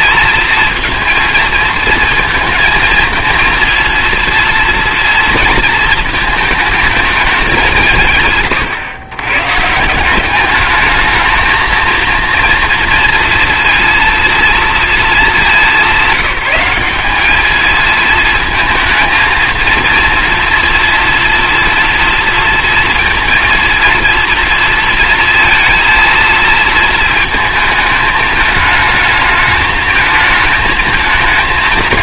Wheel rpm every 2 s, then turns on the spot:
220, 230, 230, 220, 130, 210, 230, 230, 190, 220, 230, 230, 230, 230, 220, 220.
none